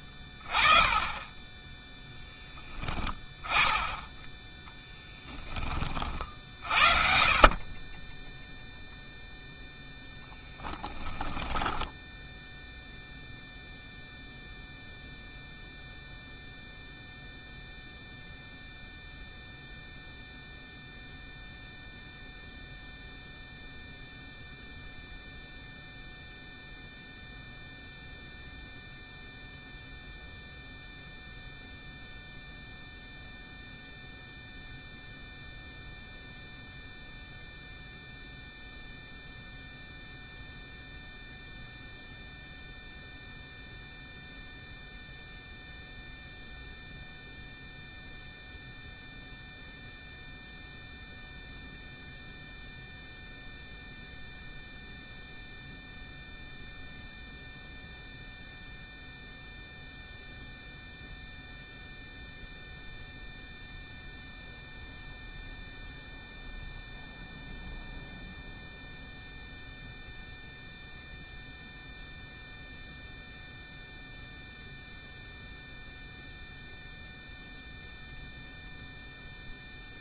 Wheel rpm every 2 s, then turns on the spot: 20, 10, 10, 40, 0, 10, 0, 0, 0, 0, 0, 0, 0, 0, 0, 0, 0, 0, 0, 0, 0, 0, 0, 0, 0, 0, 0, 0, 0, 0, 0, 0, 0, 0, 0, 0, 0, 0, 0, 0.
4-6 10-12